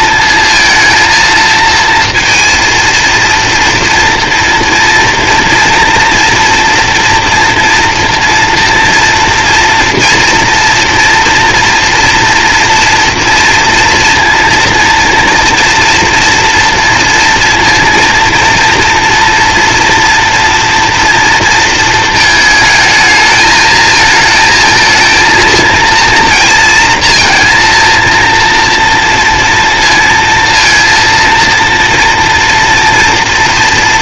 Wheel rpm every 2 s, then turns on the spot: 230, 230, 230, 230, 230, 230, 230, 230, 230, 230, 230, 220, 230, 230, 230, 230, 240.
none